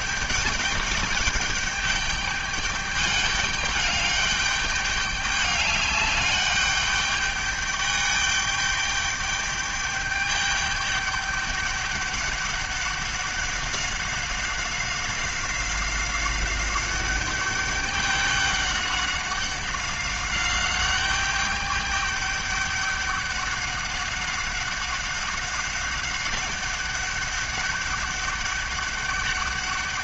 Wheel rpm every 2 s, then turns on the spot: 210, 210, 200, 210, 210, 200, 200, 190, 200, 200, 200, 200, 190, 200, 200.
none